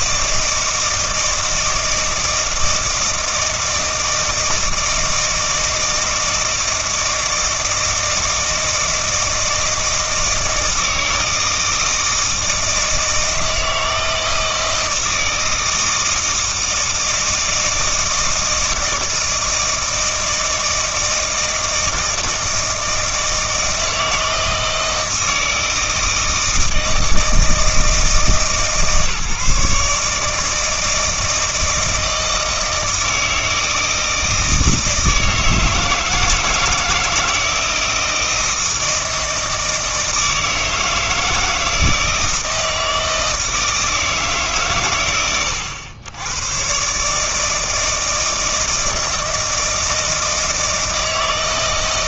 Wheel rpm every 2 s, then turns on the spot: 160, 160, 160, 160, 160, 160, 160, 160, 160, 160, 160, 160, 160, 160, 150, 160, 160, 160, 160, 160, 160, 160, 120, 140, 160, 160.
none